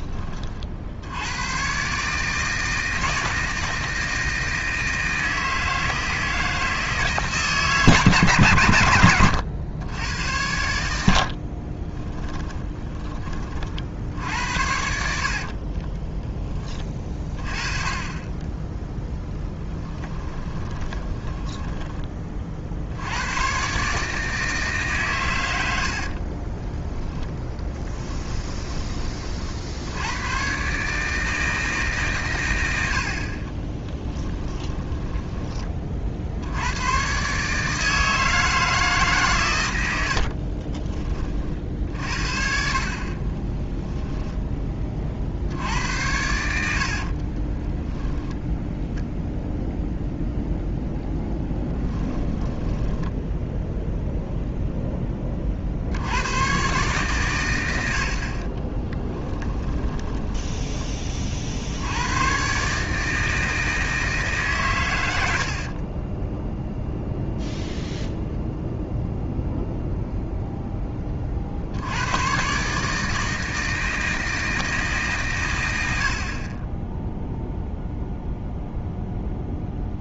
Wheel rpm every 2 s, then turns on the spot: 60, 160, 160, 160, 120, 90, 10, 70, 20, 10, 20, 60, 140, 10, 20, 140, 90, 10, 100, 160, 40, 40, 20, 70, 0, 0, 10, 0, 130, 30, 20, 140, 120, 0, 0, 10, 140, 160, 20, 0.
20-22 26-28 34-36 40-42 46-48 52-54 58-60